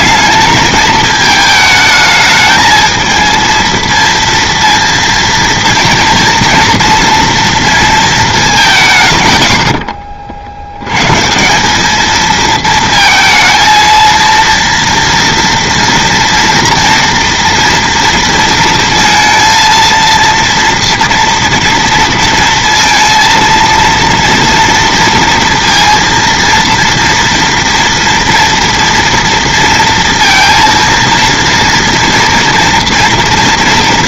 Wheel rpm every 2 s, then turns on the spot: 210, 220, 230, 230, 200, 70, 220, 230, 230, 230, 230, 230, 230, 230, 230, 230, 230.
none